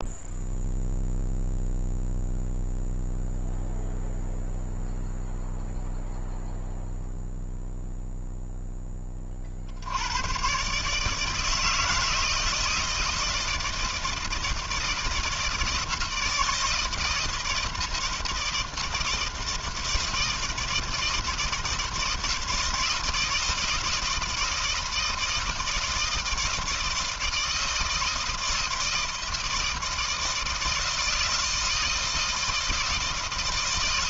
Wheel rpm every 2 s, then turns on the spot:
0, 0, 0, 0, 0, 130, 160, 160, 160, 160, 160, 160, 160, 160, 160, 160, 160.
none